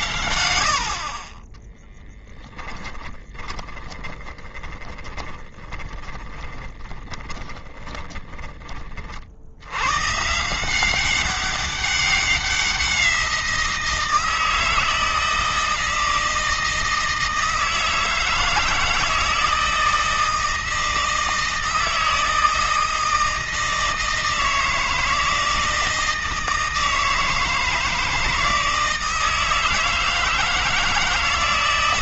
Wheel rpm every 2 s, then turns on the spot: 60, 10, 10, 20, 40, 180, 180, 160, 160, 160, 160, 160, 160, 160, 160, 160.
2-8